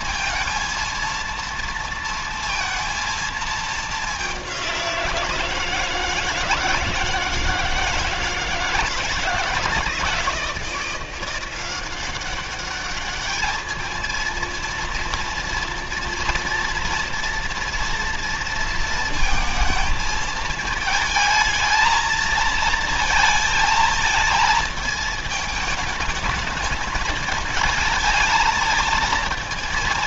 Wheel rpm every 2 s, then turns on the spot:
230, 230, 190, 160, 160, 170, 200, 230, 230, 230, 220, 220, 220, 220, 220.
none